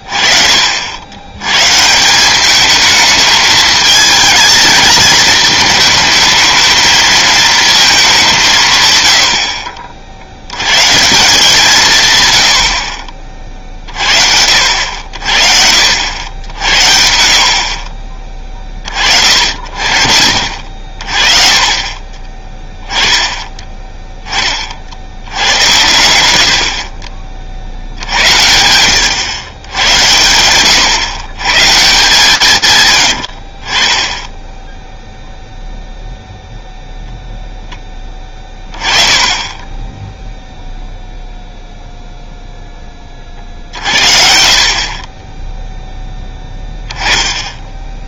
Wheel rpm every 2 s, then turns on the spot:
60, 210, 220, 220, 150, 110, 60, 70, 80, 30, 40, 10, 40, 60, 80, 120, 150, 10, 0, 10, 0, 0, 50, 10.
34-36